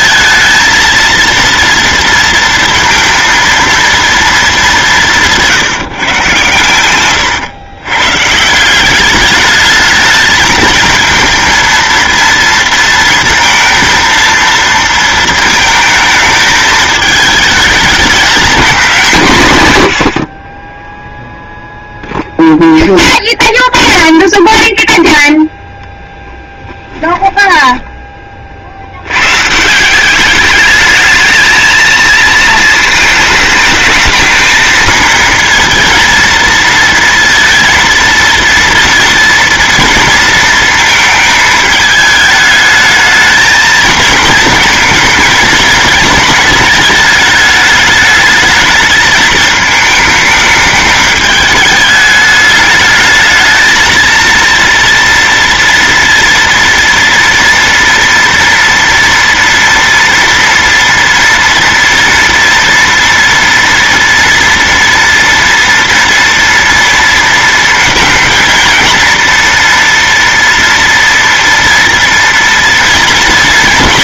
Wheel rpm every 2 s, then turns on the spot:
230, 230, 210, 120, 160, 220, 230, 230, 220, 210, 30, 0, 0, 10, 50, 210, 220, 220, 230, 230, 230, 220, 220, 220, 220, 210, 210, 230, 230, 230, 230, 230, 230, 230, 230, 230, 230.
26-28